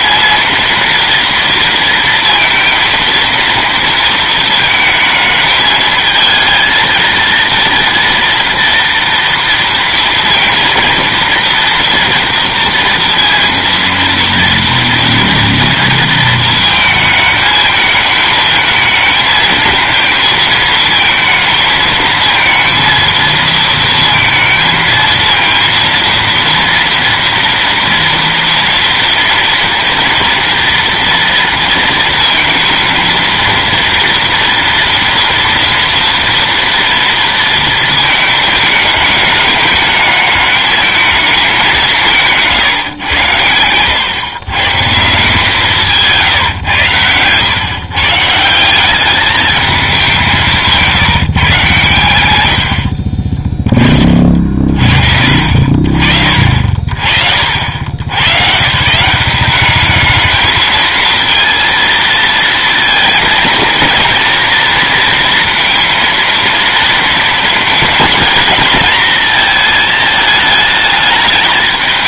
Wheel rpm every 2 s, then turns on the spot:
230, 230, 220, 230, 230, 230, 230, 230, 220, 220, 230, 230, 230, 230, 230, 230, 230, 230, 230, 210, 220, 110, 160, 120, 200, 160, 40, 40, 50, 160, 230, 230, 230, 230, 220, 210.
52-54